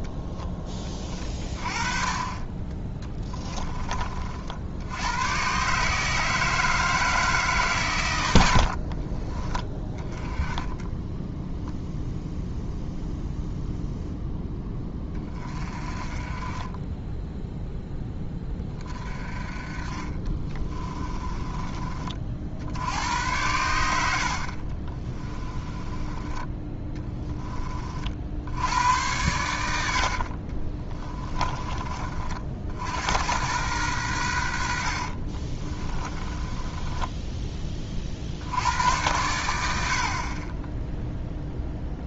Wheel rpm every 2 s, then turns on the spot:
20, 20, 80, 160, 50, 10, 0, 10, 20, 20, 30, 60, 40, 10, 90, 30, 70, 70, 20, 100, 10.
8-10 20-22 24-26 30-32 36-38